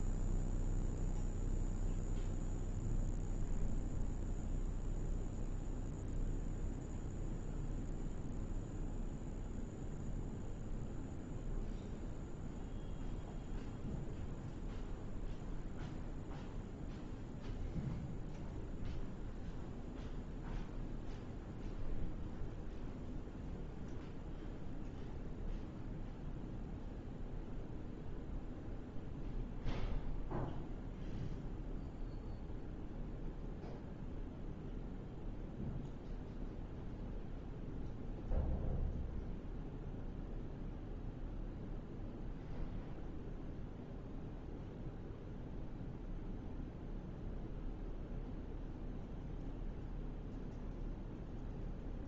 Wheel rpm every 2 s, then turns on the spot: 0, 0, 0, 0, 0, 0, 0, 0, 0, 0, 0, 0, 0, 0, 0, 0, 0, 0, 0, 0, 0, 0, 0, 0, 0, 0.
none